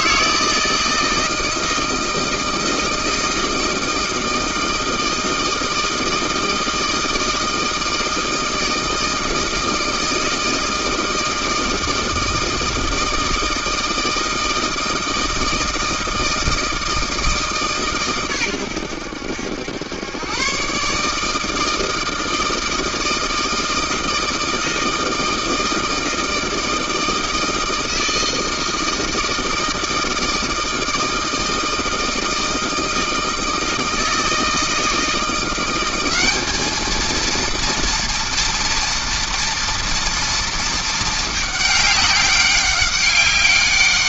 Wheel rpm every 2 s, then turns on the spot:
160, 160, 160, 160, 160, 160, 160, 160, 160, 120, 120, 160, 160, 160, 160, 160, 160, 160, 200, 230, 230, 200.
none